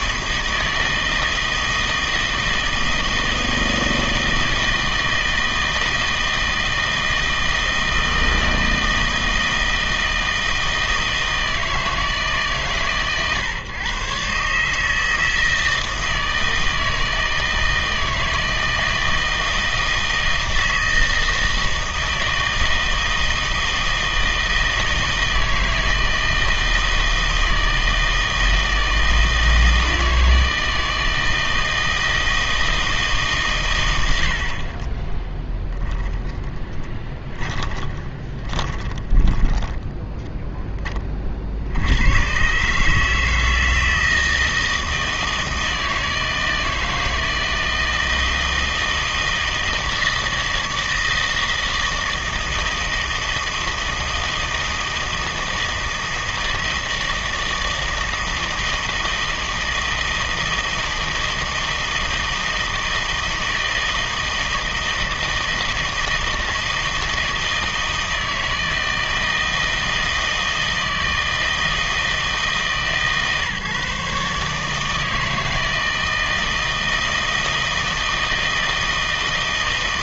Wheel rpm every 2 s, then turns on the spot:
160, 160, 160, 160, 160, 160, 130, 150, 160, 160, 160, 160, 160, 160, 160, 160, 160, 40, 10, 20, 20, 150, 160, 160, 160, 160, 160, 160, 160, 160, 160, 160, 160, 160, 160, 160, 140, 150, 160, 160.
36-42